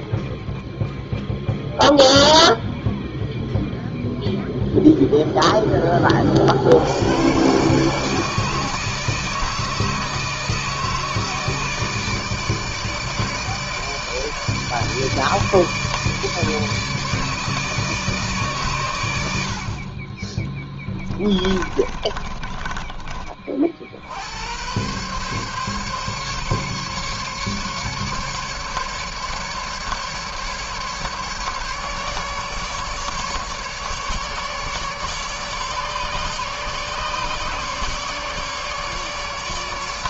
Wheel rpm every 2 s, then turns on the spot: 0, 0, 0, 60, 160, 160, 160, 150, 150, 130, 20, 20, 100, 140, 140, 150, 150, 150, 140, 150.
20-24